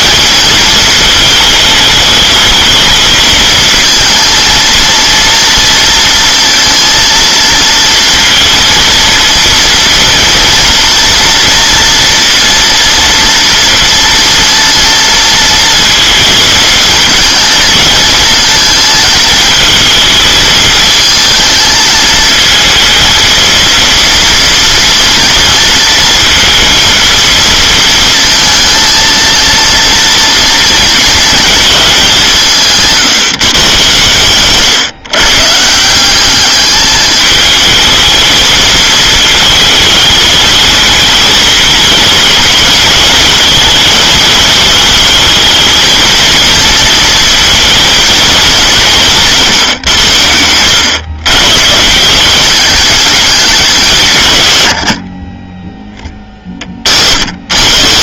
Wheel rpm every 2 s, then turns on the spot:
220, 220, 230, 230, 230, 230, 230, 230, 230, 230, 220, 220, 230, 230, 230, 230, 180, 130, 210, 220, 220, 210, 210, 230, 190, 100, 210, 100, 40.
none